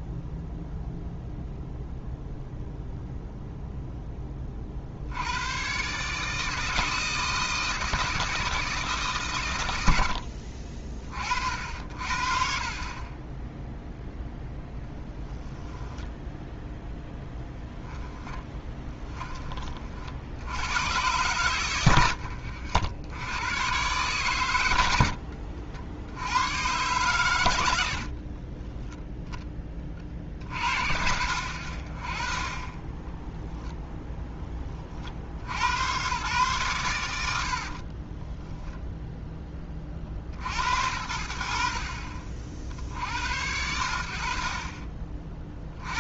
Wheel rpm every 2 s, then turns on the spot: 0, 0, 50, 160, 160, 40, 30, 10, 0, 30, 100, 70, 80, 120, 10, 60, 20, 40, 110, 0, 60, 70, 30.
14-16 18-20 24-26 28-30